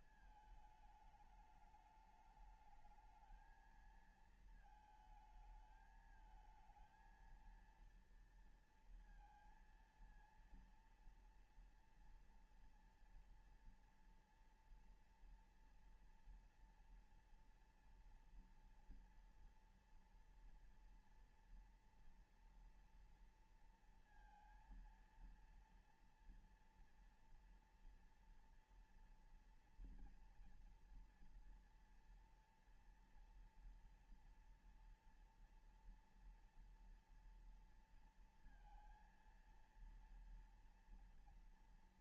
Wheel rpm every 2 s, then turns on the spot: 220, 210, 230, 220, 230, 230, 230, 230, 230, 240, 240, 240, 230, 230, 230, 240, 230, 230, 230, 230, 230.
none